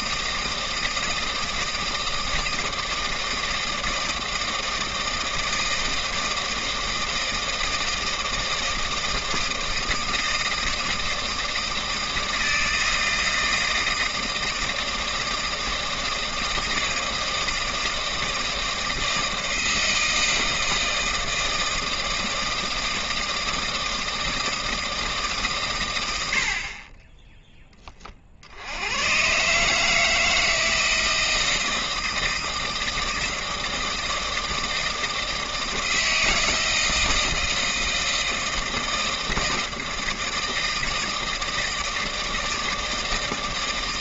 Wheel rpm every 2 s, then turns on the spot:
160, 160, 160, 160, 160, 170, 160, 160, 160, 160, 160, 160, 160, 40, 90, 160, 160, 160, 160, 160, 160, 160.
none